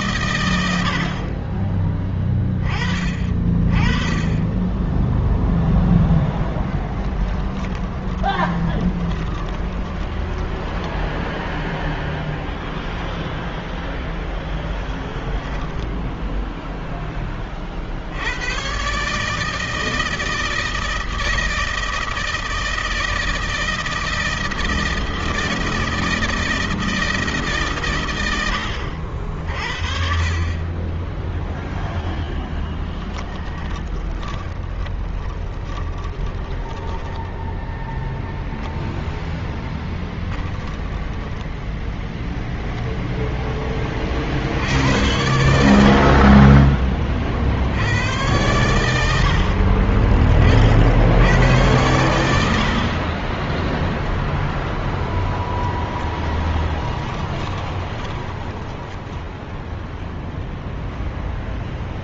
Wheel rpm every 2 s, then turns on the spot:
120, 20, 20, 10, 20, 10, 0, 10, 0, 80, 160, 160, 160, 160, 110, 30, 10, 20, 10, 0, 10, 10, 50, 40, 100, 30, 90, 0, 10, 20, 0.
6-12 32-38 56-60